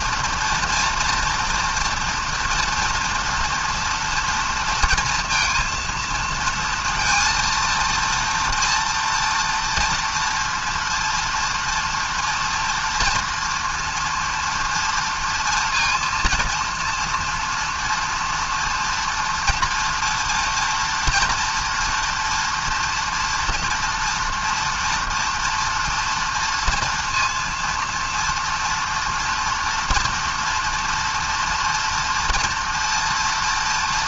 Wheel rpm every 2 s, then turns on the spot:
230, 230, 240, 230, 230, 230, 240, 230, 230, 230, 230, 230, 230, 230, 230, 230, 230.
none